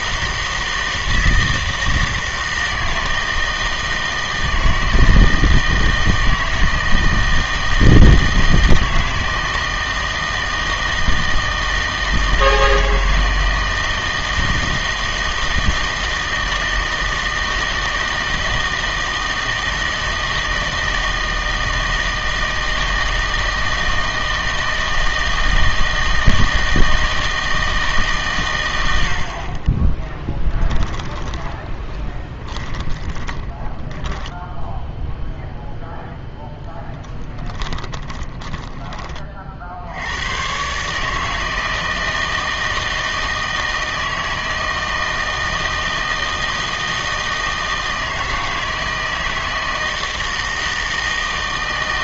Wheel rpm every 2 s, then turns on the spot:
160, 160, 160, 160, 160, 160, 160, 160, 160, 160, 160, 160, 160, 160, 100, 20, 20, 0, 10, 10, 130, 160, 160, 160, 160, 160.
30-34 38-40